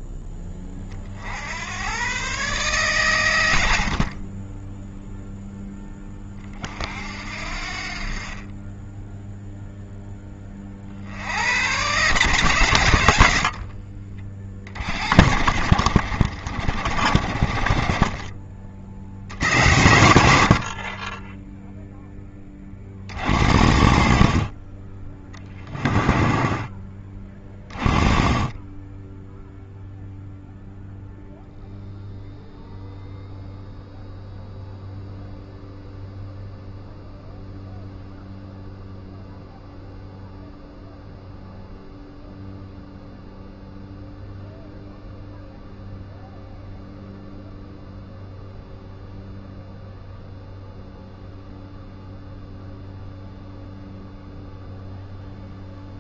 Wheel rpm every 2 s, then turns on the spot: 20, 130, 10, 40, 20, 30, 130, 50, 50, 40, 60, 20, 40, 30, 20, 0, 0, 0, 0, 0, 0, 0, 0, 0, 0, 0, 0, 0.
4-6